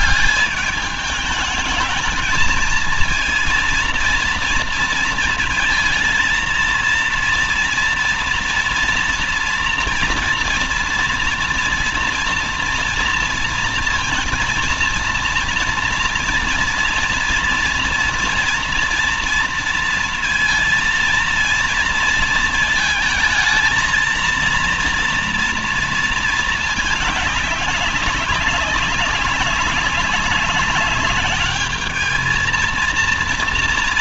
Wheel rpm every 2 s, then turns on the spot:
200, 220, 230, 230, 240, 240, 230, 230, 230, 240, 230, 220, 230, 210, 200, 200, 230.
none